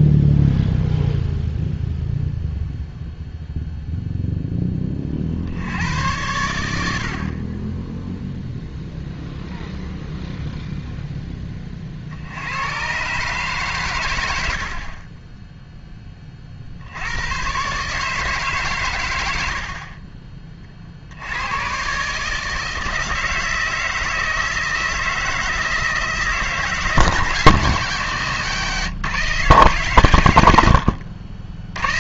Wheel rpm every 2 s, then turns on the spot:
0, 0, 10, 80, 0, 0, 100, 50, 60, 120, 40, 160, 160, 160, 150, 90.
none